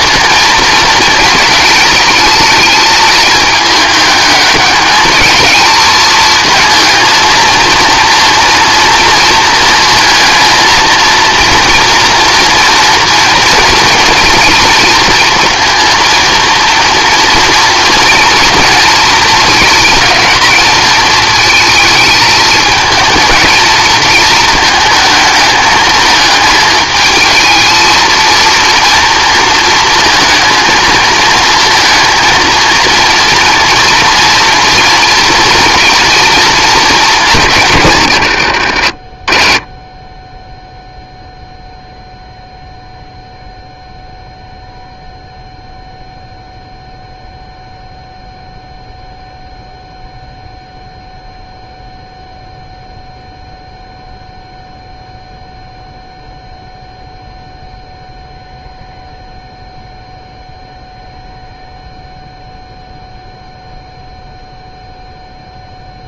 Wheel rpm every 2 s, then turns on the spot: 230, 220, 210, 220, 230, 230, 230, 230, 230, 220, 220, 220, 220, 220, 230, 220, 230, 230, 210, 60, 0, 0, 0, 0, 0, 0, 0, 0, 0, 0, 0, 0, 0.
none